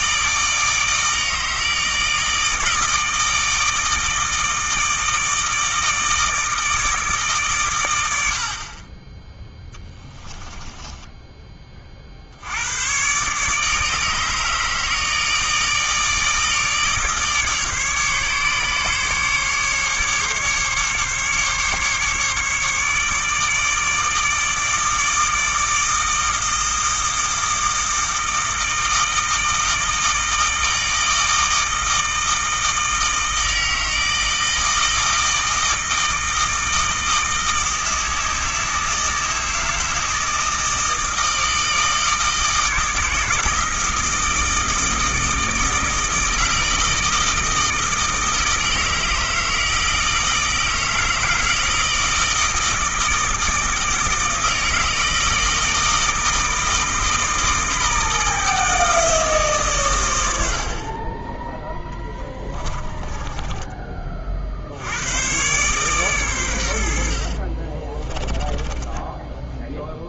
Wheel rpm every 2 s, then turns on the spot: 160, 160, 160, 160, 30, 10, 110, 150, 150, 140, 140, 150, 160, 160, 160, 160, 160, 160, 160, 160, 160, 160, 160, 160, 160, 160, 160, 160, 160, 160, 30, 20, 90, 80, 20.
10-12 62-64 68-70